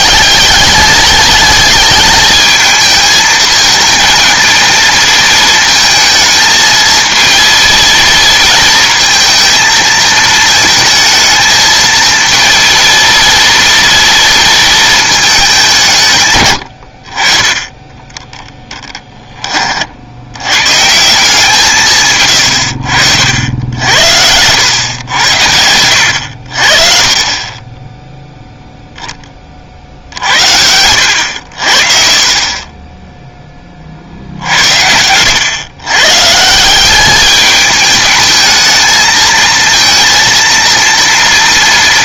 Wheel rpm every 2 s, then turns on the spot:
210, 220, 220, 220, 230, 220, 230, 230, 90, 20, 130, 70, 100, 60, 0, 80, 20, 80, 180, 220, 230.
18-20 24-26